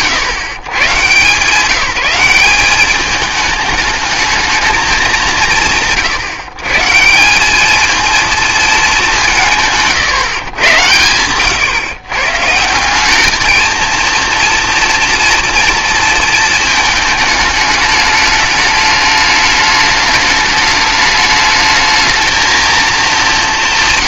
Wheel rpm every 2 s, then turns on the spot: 120, 200, 200, 160, 220, 110, 170, 230, 220, 210, 210, 230.
none